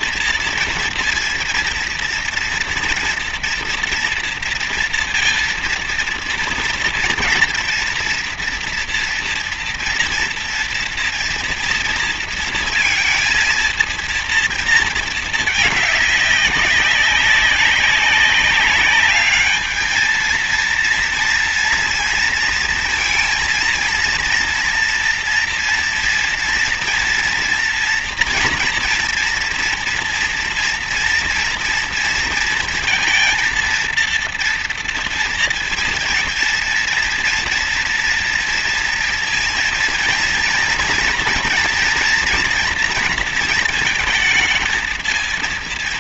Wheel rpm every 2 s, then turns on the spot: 230, 240, 230, 230, 240, 230, 230, 230, 200, 200, 230, 230, 230, 230, 230, 230, 230, 230, 230, 230, 240, 240, 220.
none